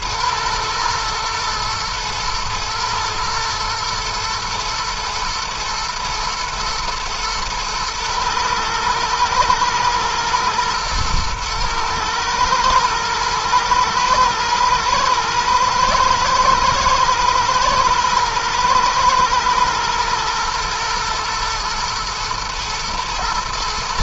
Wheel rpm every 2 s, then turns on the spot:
110, 110, 110, 110, 110, 110, 110, 110, 110, 120, 120, 120.
none